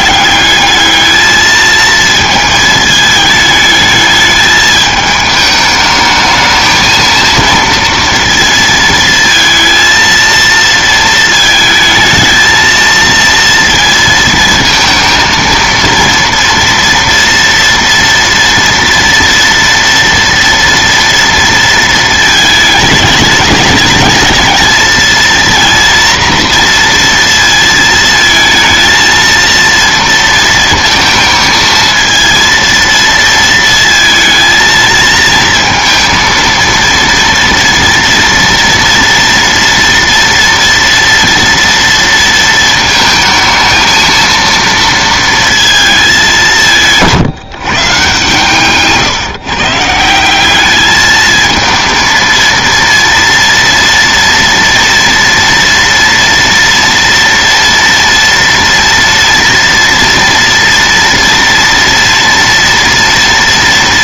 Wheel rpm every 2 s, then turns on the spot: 220, 220, 210, 220, 230, 230, 230, 230, 230, 230, 230, 210, 220, 230, 230, 230, 230, 220, 230, 230, 230, 230, 230, 170, 140, 210, 230, 230, 230, 230, 240, 230.
46-48